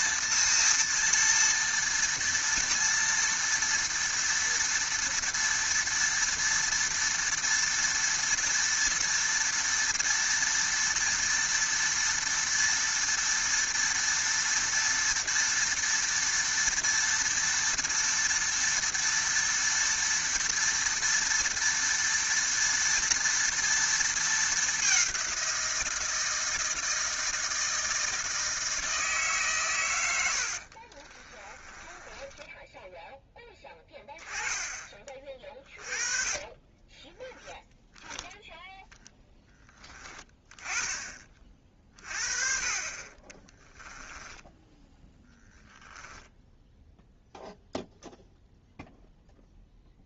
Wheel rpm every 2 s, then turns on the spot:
230, 230, 230, 230, 230, 230, 230, 240, 230, 230, 230, 230, 200, 160, 160, 60, 10, 20, 20, 0, 20, 40, 20, 0, 0.
30-34 44-46